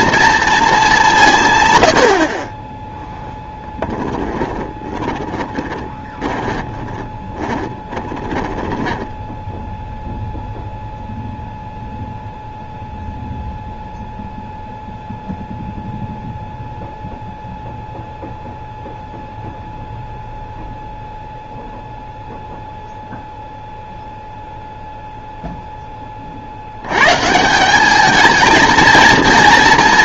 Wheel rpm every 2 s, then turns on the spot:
210, 10, 20, 10, 10, 0, 0, 0, 0, 0, 0, 0, 0, 90, 230.
4-10